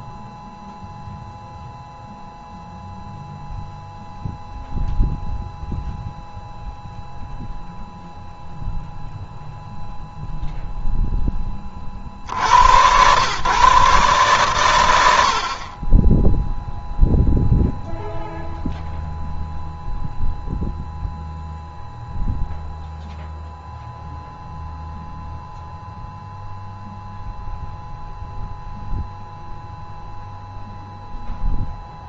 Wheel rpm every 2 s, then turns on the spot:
0, 0, 0, 0, 0, 0, 100, 100, 0, 0, 0, 0, 0, 0, 0, 0.
none